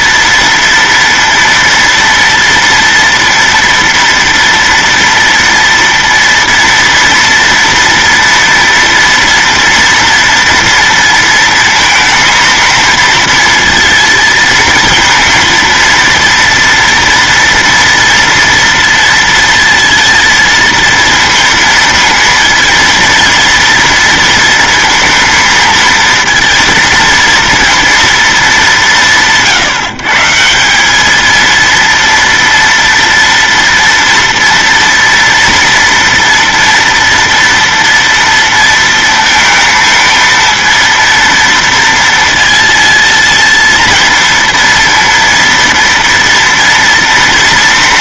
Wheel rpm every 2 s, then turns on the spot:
230, 230, 230, 230, 230, 230, 230, 230, 230, 230, 230, 230, 230, 230, 180, 190, 230, 230, 240, 230, 230, 230, 230, 230.
none